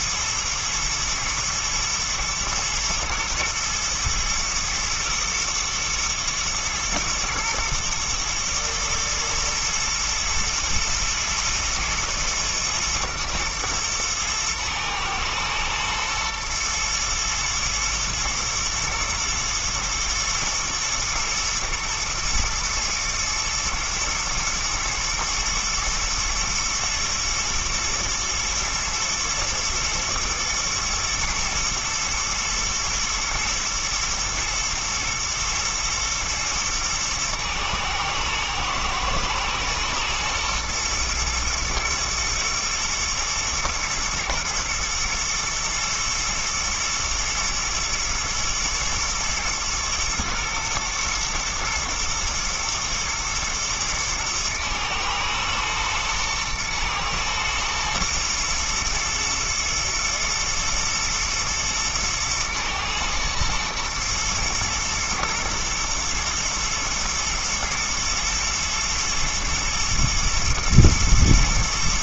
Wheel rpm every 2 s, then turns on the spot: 120, 120, 110, 120, 120, 110, 110, 110, 110, 110, 110, 120, 110, 110, 110, 120, 110, 120, 110, 110, 110, 120, 110, 120, 110, 120, 120, 110, 110, 110, 110, 110, 110, 110, 120, 120.
none